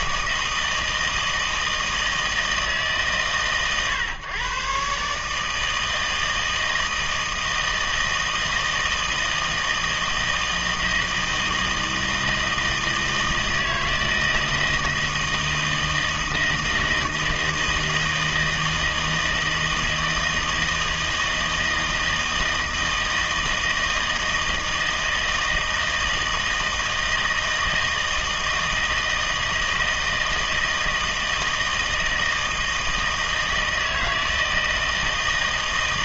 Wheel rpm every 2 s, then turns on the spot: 160, 140, 150, 160, 160, 160, 160, 160, 160, 160, 160, 160, 160, 160, 160, 160, 160, 160.
none